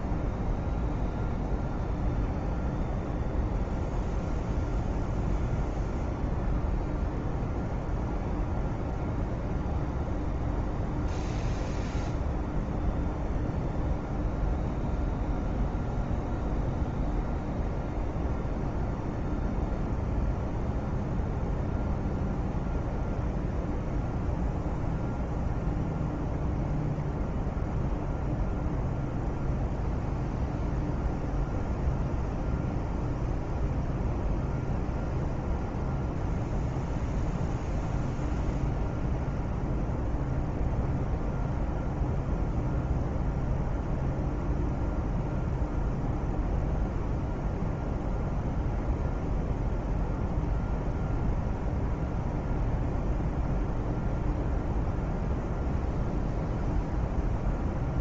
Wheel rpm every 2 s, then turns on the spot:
0, 0, 0, 0, 0, 0, 0, 0, 0, 0, 0, 0, 0, 0, 0, 0, 0, 0, 0, 0, 0, 0, 0, 0, 0, 0, 0, 0, 0.
none